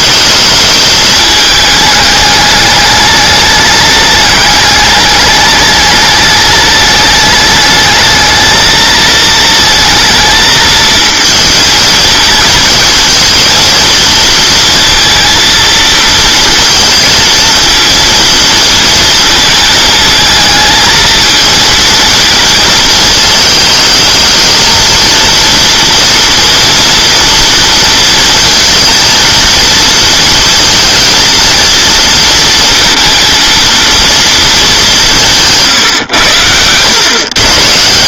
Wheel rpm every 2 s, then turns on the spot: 220, 210, 210, 210, 220, 220, 230, 230, 230, 230, 220, 220, 230, 230, 230, 230, 230, 210, 100.
none